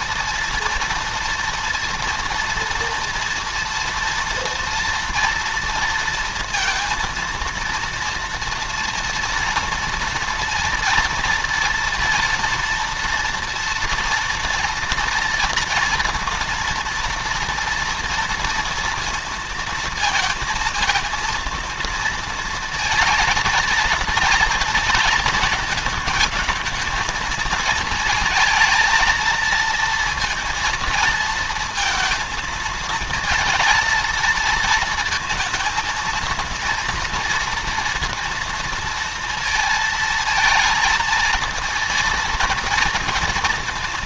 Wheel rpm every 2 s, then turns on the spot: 230, 230, 230, 230, 240, 240, 240, 240, 230, 230, 230, 230, 230, 220, 220, 230, 220, 230, 230, 230, 220, 230.
none